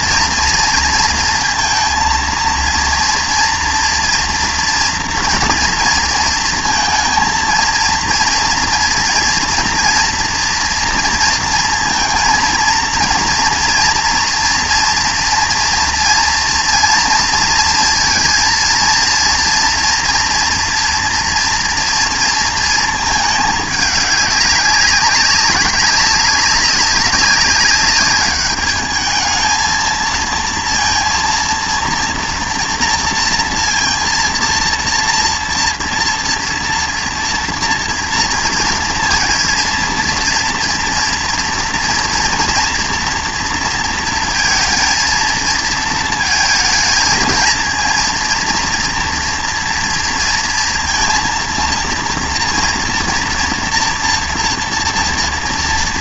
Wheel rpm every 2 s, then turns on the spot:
230, 230, 240, 230, 230, 230, 230, 230, 230, 230, 240, 230, 190, 200, 210, 230, 230, 230, 230, 230, 230, 230, 230, 230, 230, 230, 230, 240.
none